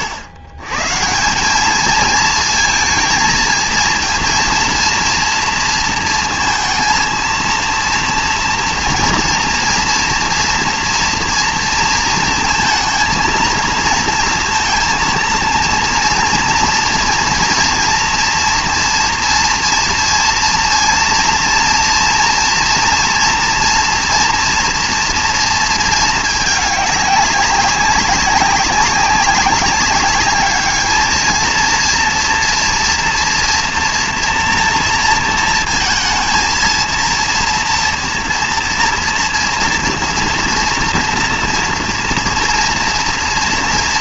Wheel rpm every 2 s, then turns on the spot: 130, 220, 230, 230, 230, 230, 230, 230, 230, 230, 230, 230, 230, 200, 190, 220, 230, 230, 230, 230, 230, 230.
none